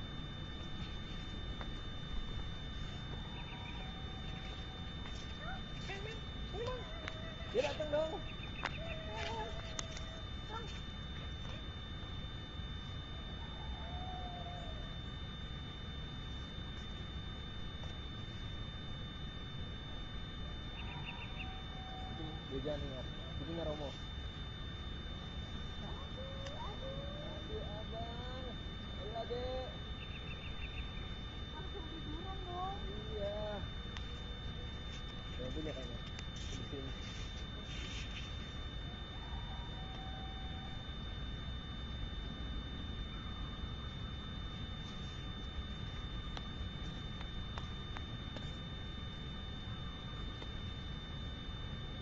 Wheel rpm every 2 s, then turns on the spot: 0, 0, 0, 0, 0, 0, 0, 0, 0, 0, 0, 0, 0, 0, 0, 0, 0, 0, 0, 0, 0, 0, 0, 0, 0, 0.
none